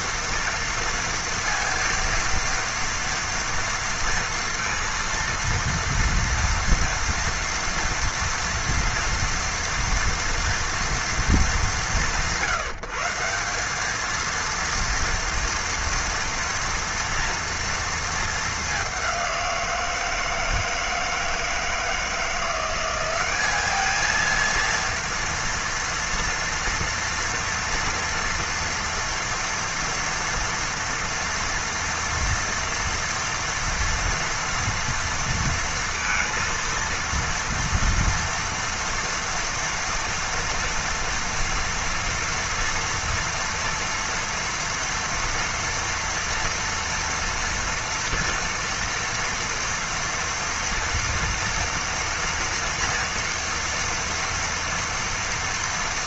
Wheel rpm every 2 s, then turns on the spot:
240, 230, 230, 230, 230, 230, 150, 230, 230, 210, 160, 180, 230, 240, 230, 230, 230, 230, 230, 230, 230, 230, 230, 230, 230, 230, 230, 230.
none